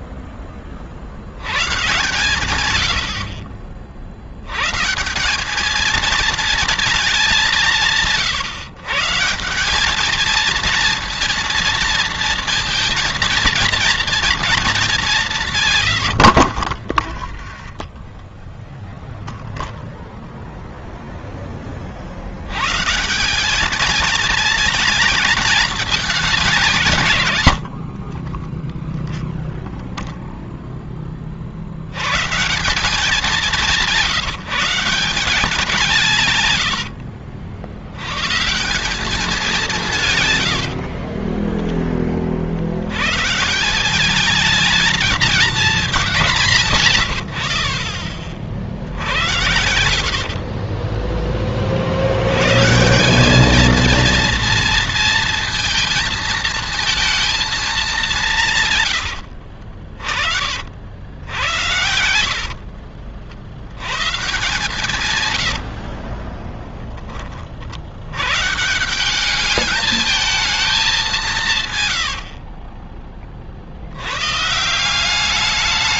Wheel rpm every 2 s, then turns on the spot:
70, 70, 190, 200, 180, 230, 230, 180, 20, 0, 70, 220, 210, 30, 0, 110, 170, 150, 100, 160, 20, 200, 180, 40, 80, 60, 230, 230, 200, 50, 80, 90, 80, 40, 210, 150, 30, 200.
16-18 48-50 60-62 64-66 70-72